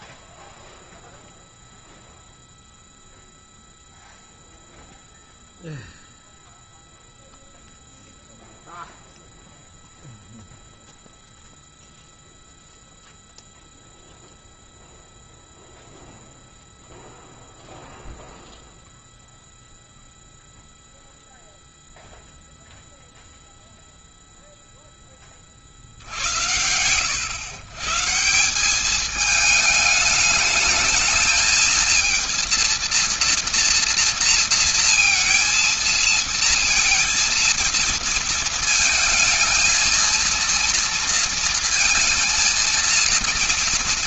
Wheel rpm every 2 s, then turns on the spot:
0, 0, 0, 0, 0, 0, 0, 0, 0, 0, 0, 0, 0, 90, 190, 220, 230, 230, 230, 230, 230, 230.
none